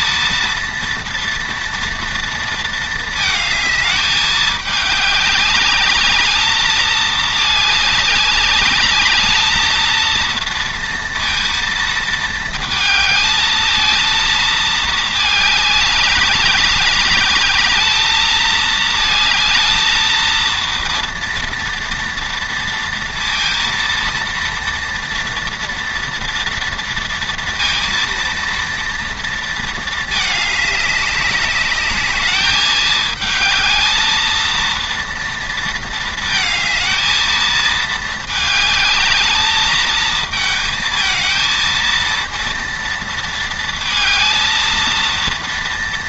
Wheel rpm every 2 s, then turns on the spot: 230, 220, 210, 210, 220, 230, 220, 210, 210, 220, 230, 230, 230, 230, 230, 200, 220, 230, 220, 220, 220, 230, 230.
none